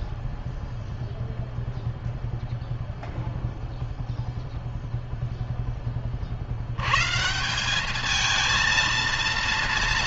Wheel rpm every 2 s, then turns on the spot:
0, 0, 0, 110, 230.
none